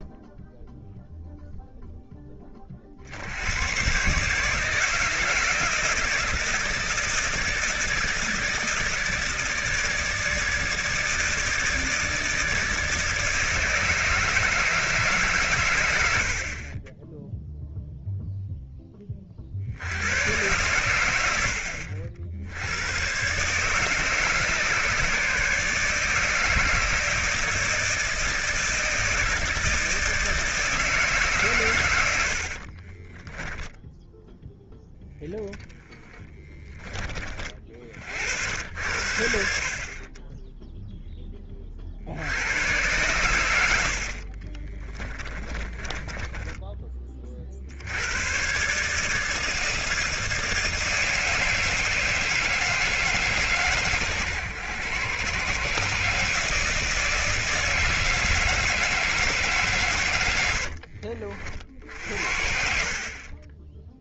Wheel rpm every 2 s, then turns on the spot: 0, 50, 160, 160, 160, 160, 160, 150, 20, 10, 100, 90, 150, 160, 160, 160, 40, 0, 20, 80, 0, 110, 30, 20, 140, 160, 160, 120, 160, 160, 60, 50.
44-46 60-62